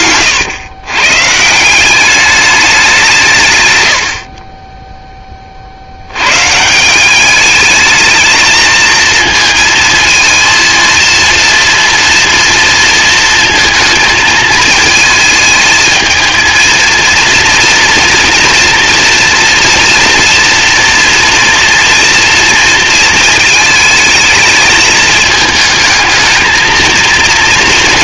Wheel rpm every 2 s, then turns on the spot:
130, 190, 10, 170, 230, 230, 230, 220, 230, 230, 230, 230, 220, 220.
none